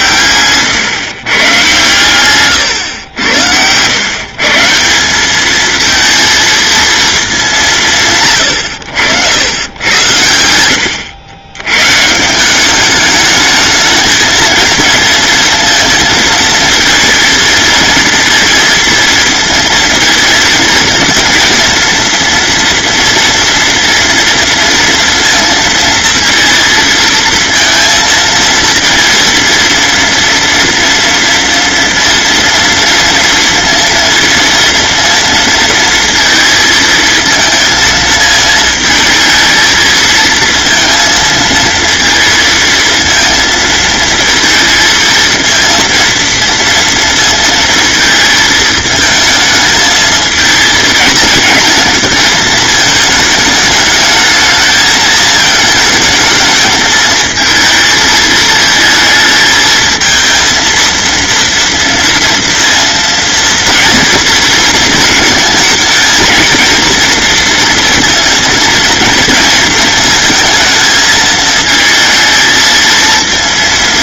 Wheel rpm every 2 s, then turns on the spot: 120, 110, 190, 220, 80, 90, 210, 220, 220, 230, 230, 230, 230, 230, 230, 230, 230, 230, 220, 220, 230, 230, 230, 230, 220, 220, 220, 220, 220, 220, 230, 230, 220, 240, 230, 220, 230.
none